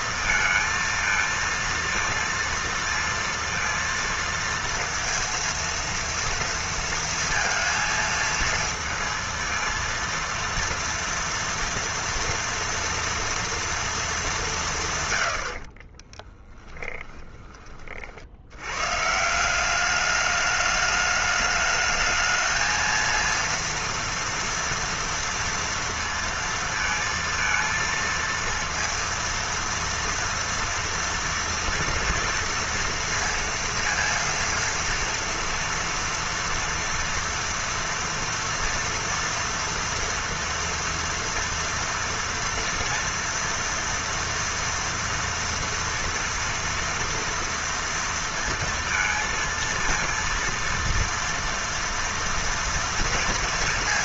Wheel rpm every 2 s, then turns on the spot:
230, 230, 230, 230, 230, 230, 230, 190, 10, 90, 210, 220, 230, 230, 230, 230, 230, 230, 230, 230, 230, 230, 230, 230, 230, 230, 230.
16-18